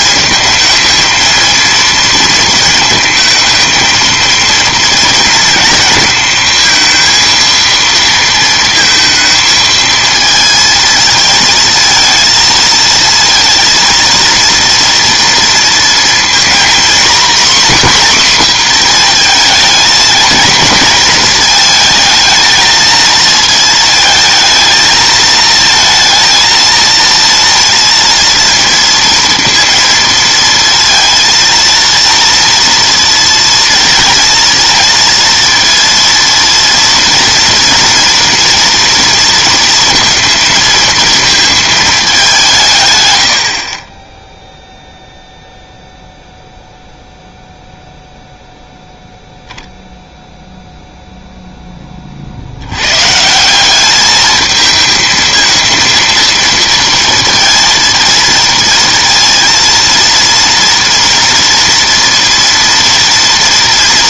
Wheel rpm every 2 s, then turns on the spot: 220, 230, 230, 230, 230, 230, 230, 230, 240, 250, 230, 220, 220, 230, 230, 230, 230, 230, 230, 240, 230, 150, 0, 0, 0, 0, 90, 220, 230, 230, 230, 230.
none